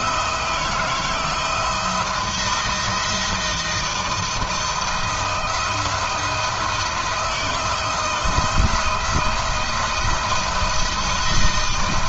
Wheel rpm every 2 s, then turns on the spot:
160, 170, 170, 170, 170, 160.
none